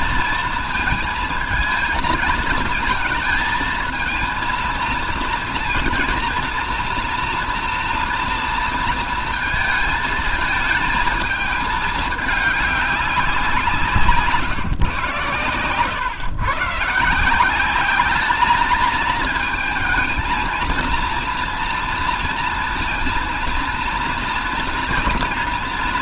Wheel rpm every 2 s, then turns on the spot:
230, 220, 230, 230, 230, 220, 210, 150, 130, 220, 230, 230, 240.
none